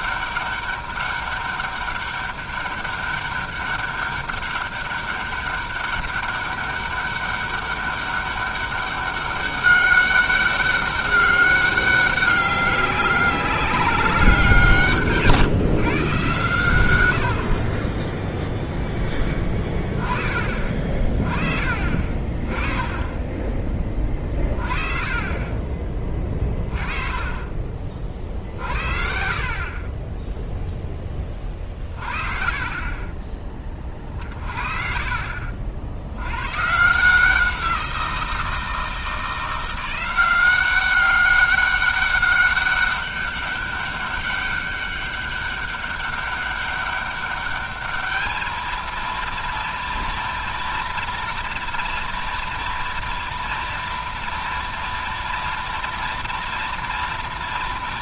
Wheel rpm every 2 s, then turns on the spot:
200, 200, 200, 200, 200, 200, 200, 180, 120, 0, 30, 20, 30, 20, 60, 0, 30, 50, 120, 160, 190, 200, 200, 200, 230, 230, 230, 230, 230.
26-28